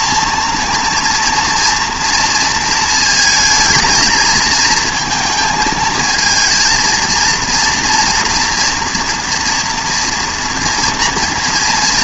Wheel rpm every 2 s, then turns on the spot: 240, 220, 220, 230, 230, 230.
none